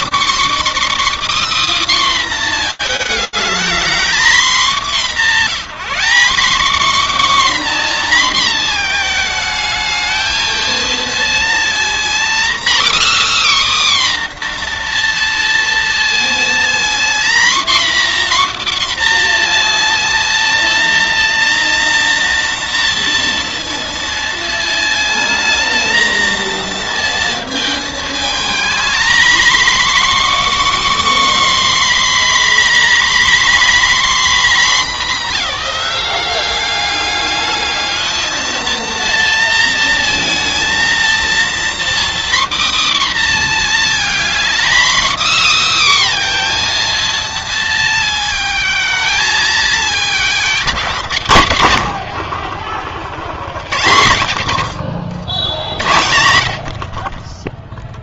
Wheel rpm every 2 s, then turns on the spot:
270, 290, 230, 210, 260, 220, 250, 290, 230, 260, 240, 240, 230, 240, 220, 260, 270, 250, 190, 220, 230, 260, 250, 280, 220, 220, 100, 100, 80.
none